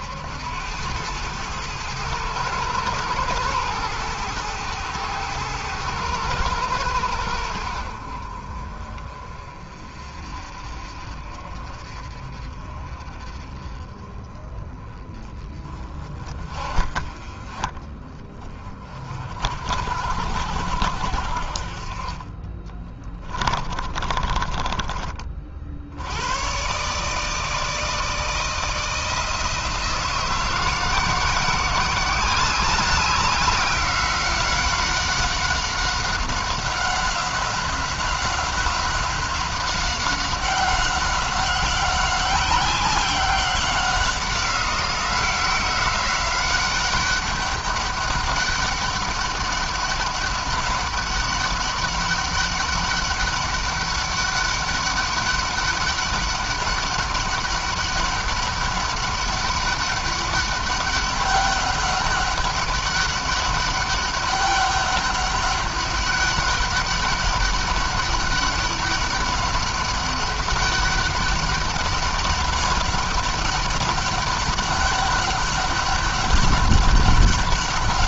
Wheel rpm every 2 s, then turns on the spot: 100, 110, 110, 100, 40, 40, 40, 30, 40, 40, 70, 20, 30, 140, 160, 170, 190, 190, 190, 190, 190, 190, 180, 190, 200, 200, 200, 200, 200, 200, 200, 200, 200, 200, 200, 200, 200, 200, 200.
22-24